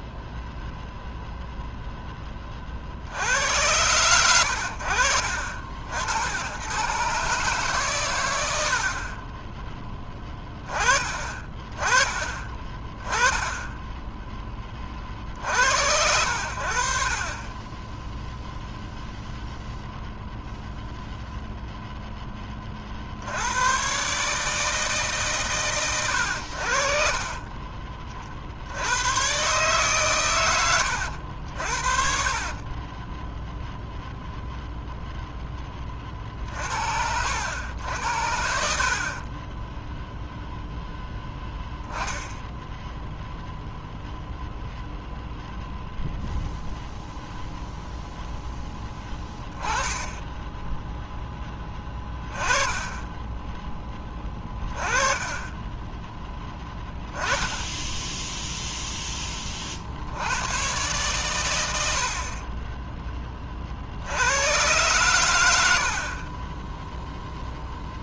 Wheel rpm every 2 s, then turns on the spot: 0, 40, 70, 110, 70, 20, 20, 30, 60, 0, 0, 30, 150, 60, 70, 100, 30, 0, 60, 50, 0, 10, 0, 0, 10, 10, 10, 20, 10, 0, 120, 20, 110, 10.
32-34 54-58